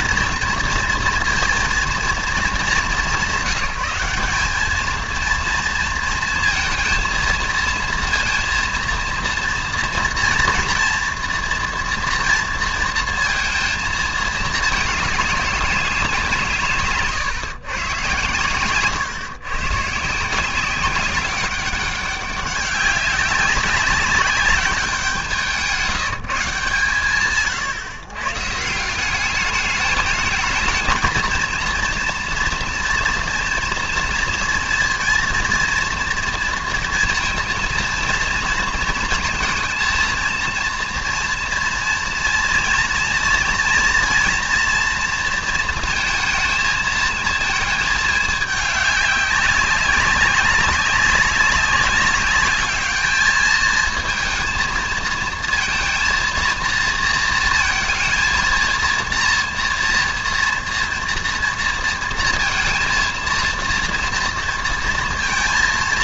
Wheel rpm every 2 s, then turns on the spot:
230, 210, 220, 230, 230, 230, 230, 210, 150, 120, 180, 190, 190, 160, 150, 220, 230, 230, 230, 230, 230, 230, 230, 220, 210, 190, 200, 230, 230, 230, 230, 220, 230.
none